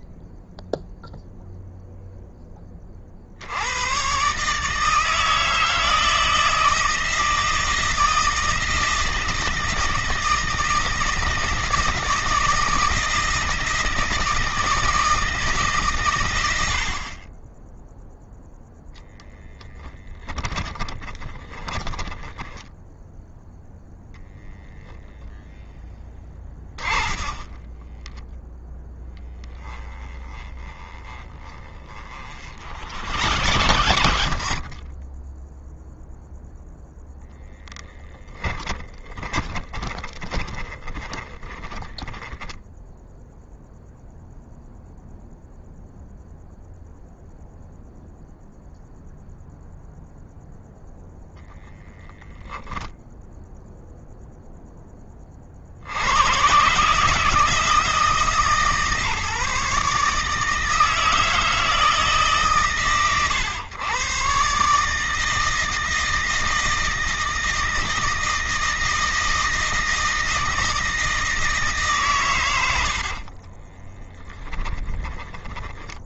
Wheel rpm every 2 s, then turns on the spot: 0, 50, 160, 160, 160, 160, 160, 160, 60, 0, 20, 0, 0, 30, 20, 40, 70, 20, 10, 20, 10, 0, 0, 0, 0, 0, 10, 20, 140, 150, 160, 130, 150, 160, 160, 160, 50, 10.
20-22 26-34 38-42 72-76